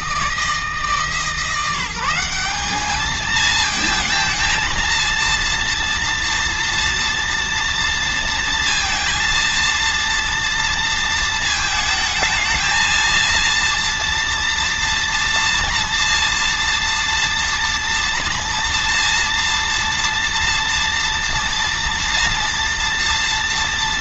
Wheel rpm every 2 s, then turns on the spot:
160, 210, 230, 230, 230, 230, 220, 230, 240, 230, 230, 230.
none